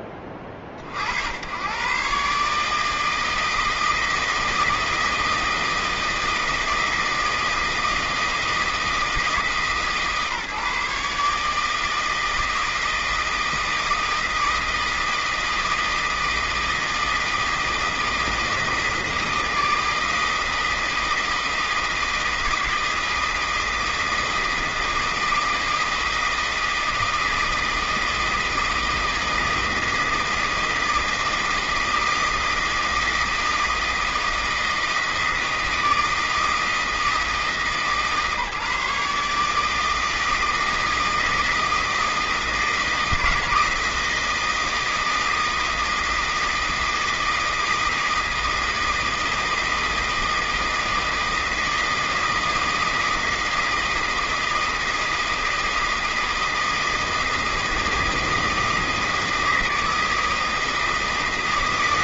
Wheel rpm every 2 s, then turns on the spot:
50, 150, 160, 160, 160, 150, 160, 160, 160, 160, 160, 160, 160, 160, 160, 160, 160, 160, 160, 150, 160, 160, 160, 160, 160, 160, 160, 160, 160, 160, 160.
none